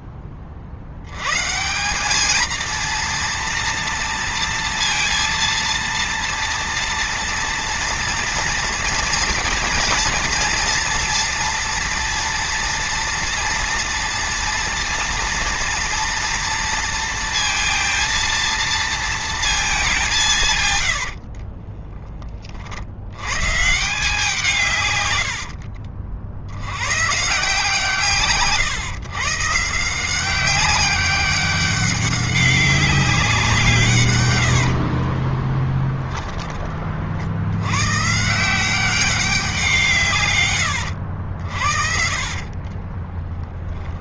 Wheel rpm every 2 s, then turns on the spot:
70, 230, 230, 230, 230, 230, 230, 230, 230, 230, 120, 70, 120, 120, 130, 200, 190, 50, 40, 180, 110, 30.
20-22 34-36 40-44